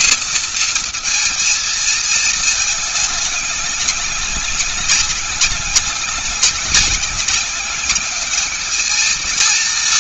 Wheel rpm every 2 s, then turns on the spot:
230, 220, 200, 190, 210.
none